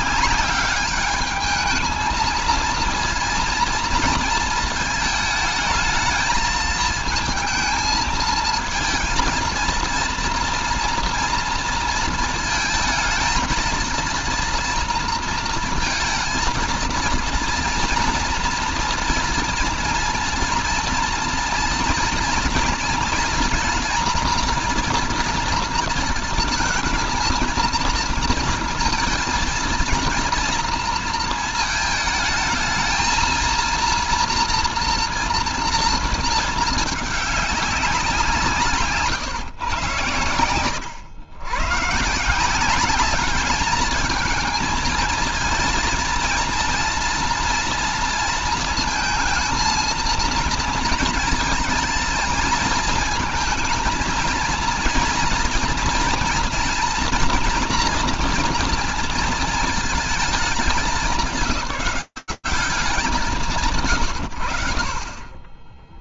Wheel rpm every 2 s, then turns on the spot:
200, 230, 220, 220, 220, 230, 220, 230, 230, 230, 230, 230, 230, 220, 230, 230, 220, 230, 220, 160, 120, 190, 220, 230, 220, 230, 230, 230, 240, 230, 200, 150, 40.
none